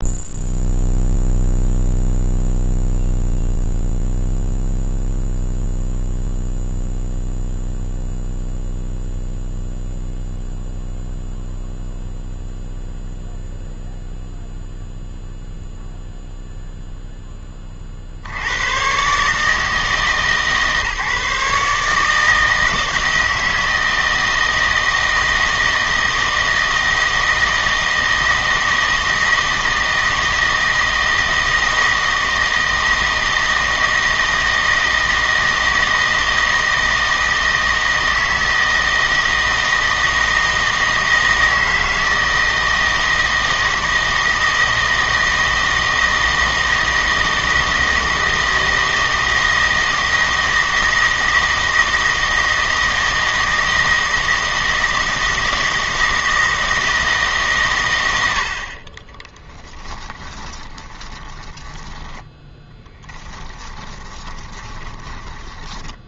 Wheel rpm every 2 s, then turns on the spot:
0, 0, 0, 0, 0, 0, 0, 0, 0, 100, 150, 160, 160, 160, 160, 160, 160, 160, 160, 160, 160, 160, 160, 160, 160, 160, 160, 160, 160, 40, 10, 10, 10.
60-66